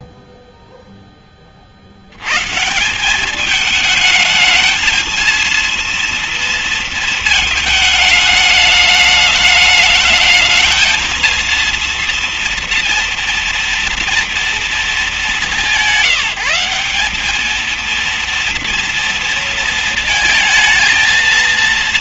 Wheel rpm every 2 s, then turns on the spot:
0, 150, 220, 230, 210, 220, 230, 230, 180, 230, 220.
none